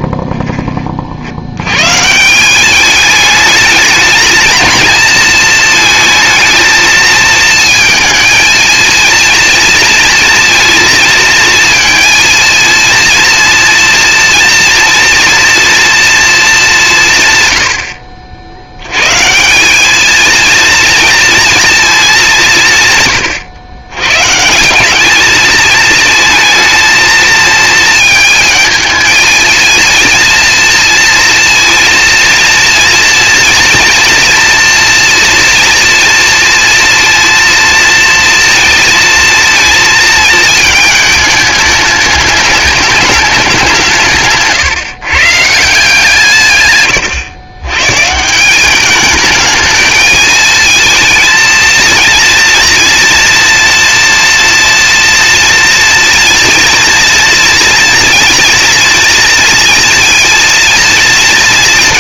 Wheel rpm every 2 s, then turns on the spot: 20, 190, 230, 230, 230, 230, 230, 230, 210, 80, 230, 160, 170, 230, 220, 230, 230, 230, 230, 230, 220, 210, 150, 120, 190, 220, 230, 240, 230, 230, 230.
44-46